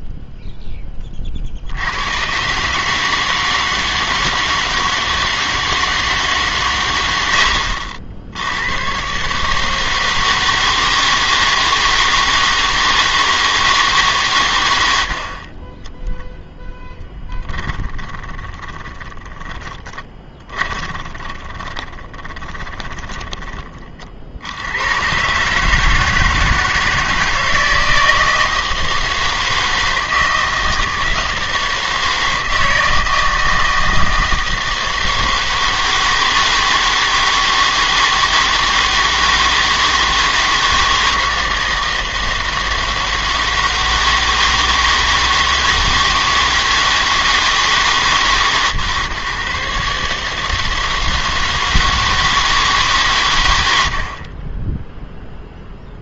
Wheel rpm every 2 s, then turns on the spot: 10, 140, 160, 130, 90, 160, 160, 100, 0, 20, 30, 20, 90, 160, 160, 160, 160, 160, 160, 160, 160, 170, 160, 160, 130, 160, 160, 20.
18-24